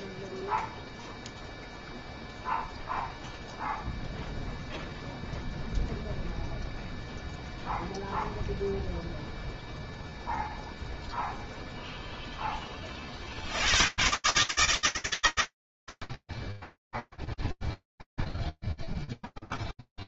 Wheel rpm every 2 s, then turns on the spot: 0, 0, 0, 0, 0, 0, 10, 160, 80, 0.
none